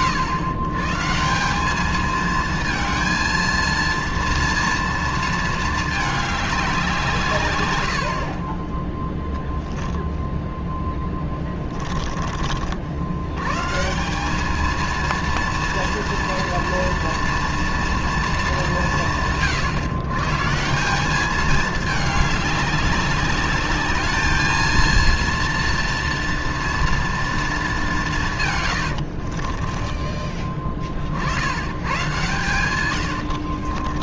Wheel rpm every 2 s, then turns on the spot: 120, 220, 230, 190, 10, 10, 80, 230, 230, 170, 180, 200, 220, 230, 90, 40, 110.
8-10 28-30 32-34